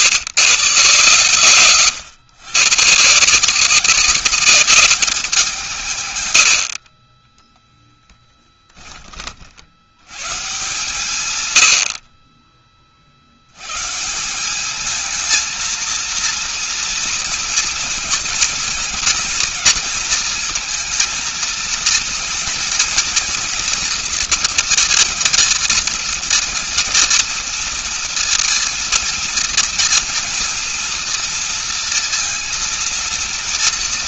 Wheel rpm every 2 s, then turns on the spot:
120, 150, 200, 40, 20, 140, 40, 210, 230, 240, 230, 240, 230, 230, 230, 230, 230.
none